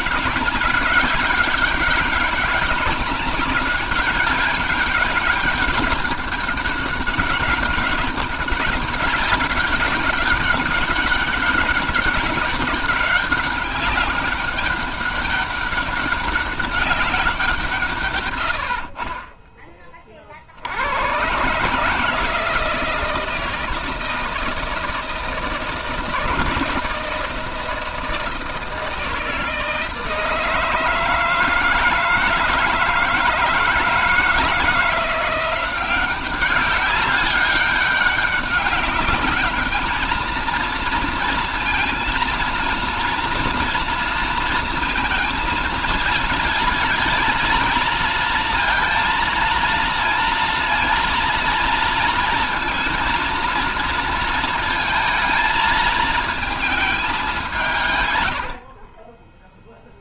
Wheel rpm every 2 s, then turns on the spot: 200, 200, 200, 200, 200, 200, 200, 200, 190, 60, 90, 160, 160, 160, 160, 160, 160, 170, 200, 200, 230, 240, 230, 230, 230, 230, 230, 230, 210, 40.
none